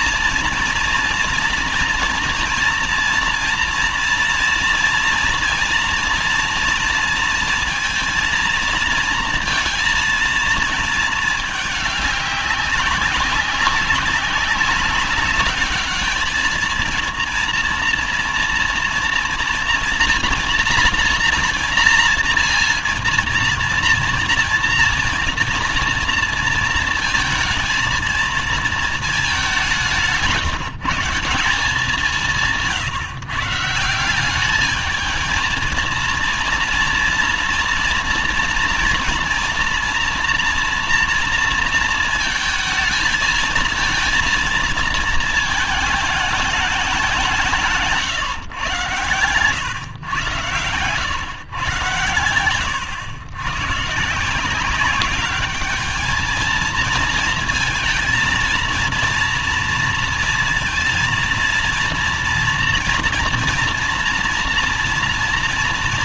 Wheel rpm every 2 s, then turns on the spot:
230, 230, 230, 230, 230, 230, 190, 200, 220, 230, 230, 230, 230, 230, 220, 150, 150, 210, 230, 240, 230, 220, 230, 210, 140, 120, 110, 190, 220, 230, 230, 240, 230.
50-54